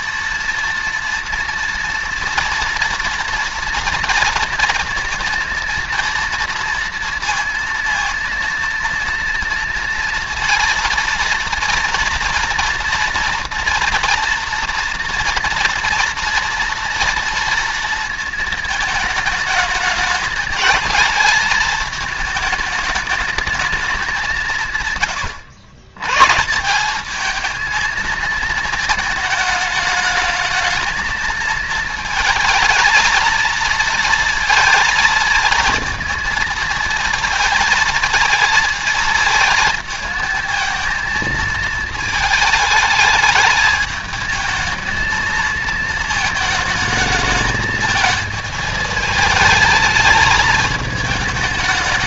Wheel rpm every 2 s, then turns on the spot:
230, 240, 230, 230, 230, 230, 240, 230, 230, 220, 220, 220, 130, 210, 220, 220, 230, 220, 230, 230, 230, 220, 220, 220, 220, 210.
none